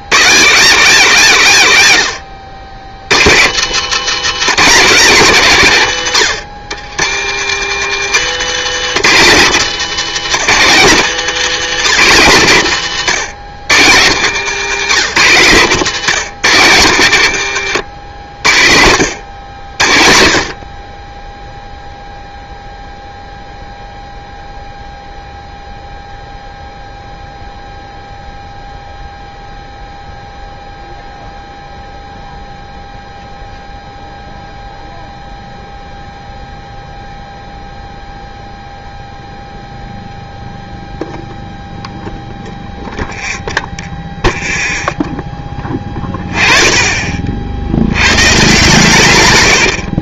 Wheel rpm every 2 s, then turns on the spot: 190, 90, 220, 110, 170, 180, 160, 150, 150, 80, 40, 0, 0, 0, 0, 0, 0, 0, 0, 0, 0, 0, 0, 20, 140.
2-4